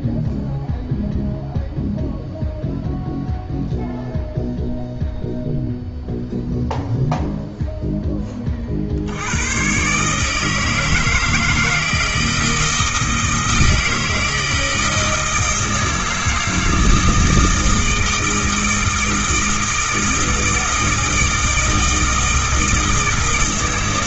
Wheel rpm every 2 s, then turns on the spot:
0, 0, 0, 0, 50, 160, 160, 160, 160, 160, 160, 160.
none